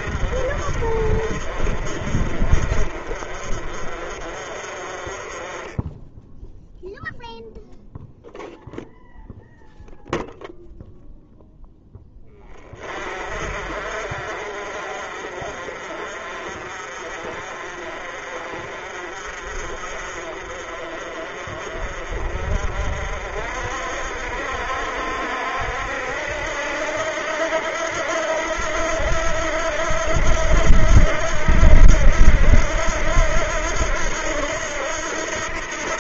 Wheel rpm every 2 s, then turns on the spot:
50, 40, 40, 0, 0, 0, 40, 50, 40, 40, 40, 50, 60, 80, 80, 80, 80, 80.
none